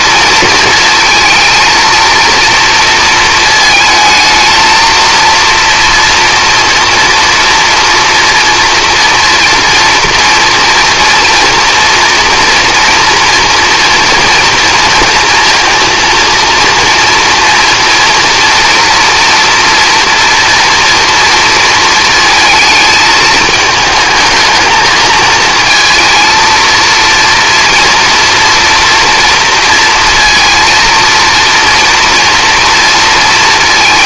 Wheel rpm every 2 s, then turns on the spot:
230, 220, 230, 230, 230, 230, 230, 230, 230, 230, 240, 220, 220, 230, 230, 230, 230.
none